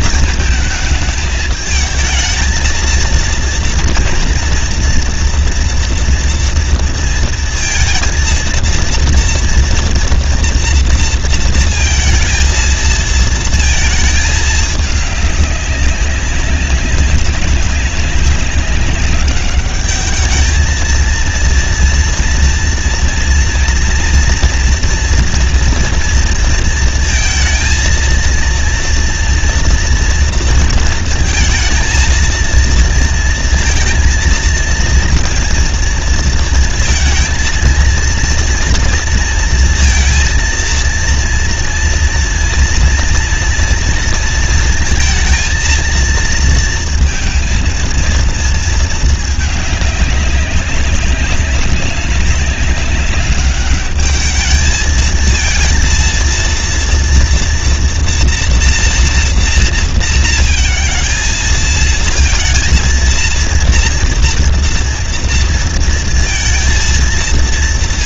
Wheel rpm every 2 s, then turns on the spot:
220, 230, 240, 230, 230, 230, 220, 210, 190, 200, 220, 240, 240, 230, 230, 230, 230, 230, 220, 230, 230, 230, 230, 230, 220, 200, 200, 220, 230, 240, 230, 230, 230, 230.
none